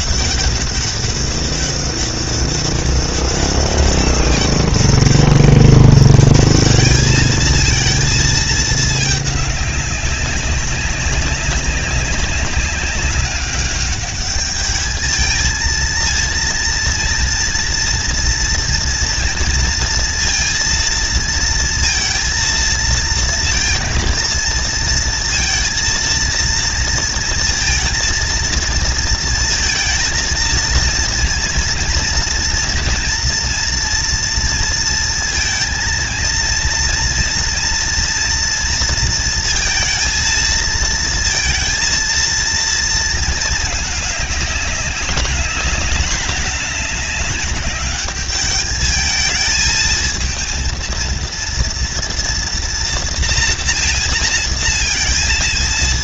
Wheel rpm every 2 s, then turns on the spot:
200, 200, 200, 210, 230, 200, 200, 210, 230, 230, 230, 230, 230, 230, 230, 230, 230, 230, 230, 230, 230, 230, 210, 210, 200, 230, 230, 230.
none